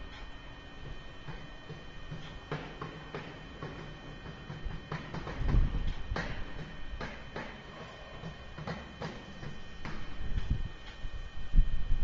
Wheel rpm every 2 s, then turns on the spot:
0, 0, 0, 0, 0, 0.
none